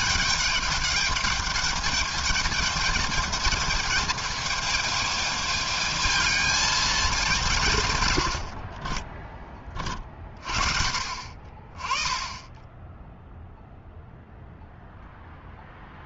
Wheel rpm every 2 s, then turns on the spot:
210, 220, 220, 220, 80, 50, 10, 0.
8-10